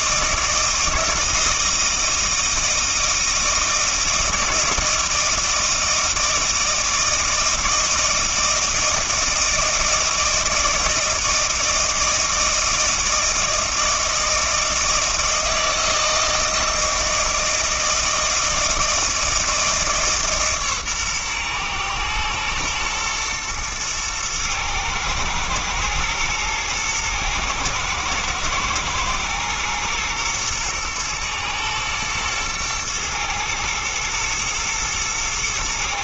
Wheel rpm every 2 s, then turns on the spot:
160, 160, 160, 160, 160, 160, 160, 160, 160, 160, 140, 110, 110, 110, 120, 110, 120, 110.
none